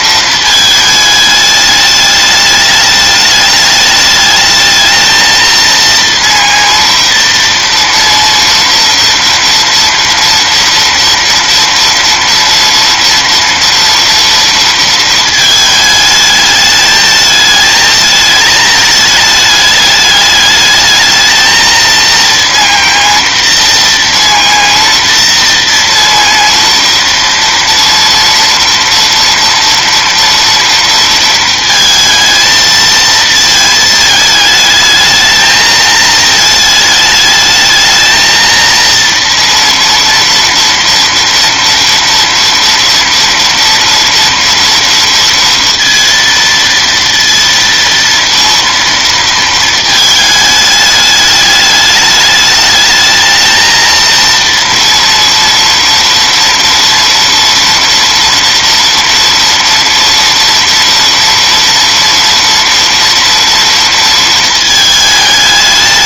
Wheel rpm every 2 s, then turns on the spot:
220, 210, 220, 230, 230, 230, 230, 230, 220, 220, 210, 230, 230, 230, 230, 230, 230, 220, 220, 230, 230, 230, 230, 230, 230, 210, 210, 230, 230, 230, 230, 230, 220.
none